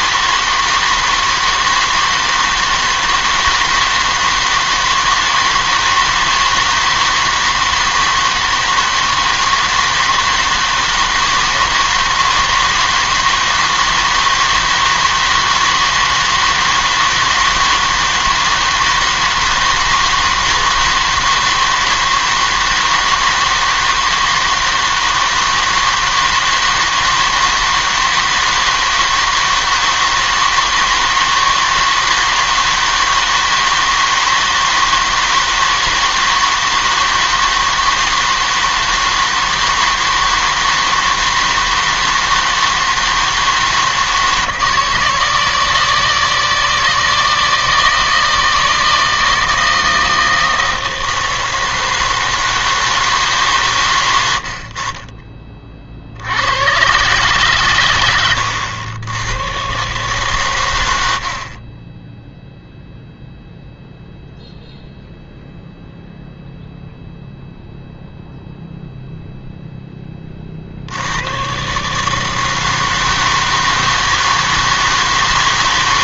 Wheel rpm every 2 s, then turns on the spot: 160, 160, 160, 160, 160, 160, 160, 160, 160, 160, 160, 160, 160, 160, 160, 160, 160, 160, 160, 160, 160, 160, 160, 160, 160, 160, 160, 50, 120, 100, 100, 0, 0, 0, 0, 60, 160, 160.
none